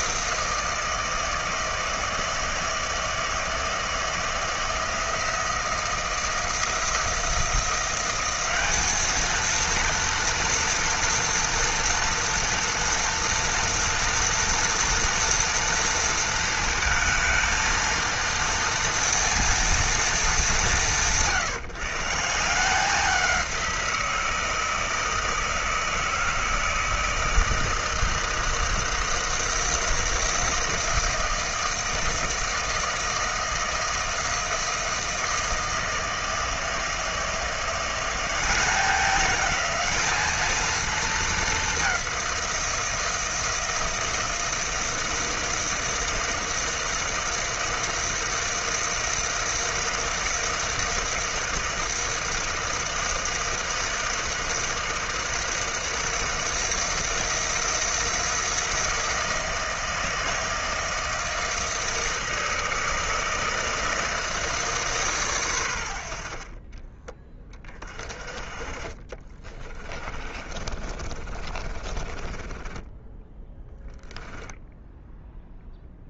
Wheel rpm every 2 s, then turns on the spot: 160, 160, 160, 170, 200, 230, 230, 230, 230, 230, 170, 160, 160, 160, 160, 160, 160, 160, 160, 190, 220, 180, 160, 160, 160, 160, 160, 160, 160, 160, 160, 160, 160, 50, 30, 30, 20, 0.
66-68 70-74